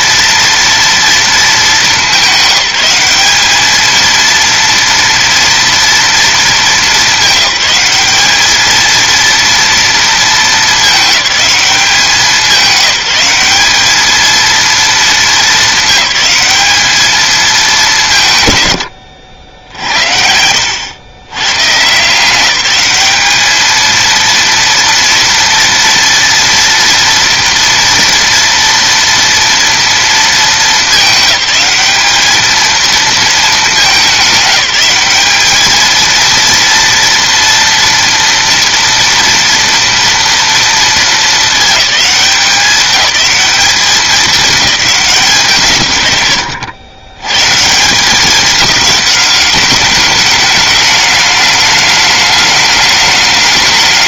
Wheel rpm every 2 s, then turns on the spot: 230, 200, 230, 220, 220, 220, 190, 230, 210, 130, 90, 190, 230, 230, 230, 220, 220, 200, 230, 230, 230, 200, 210, 110, 200, 210, 210.
none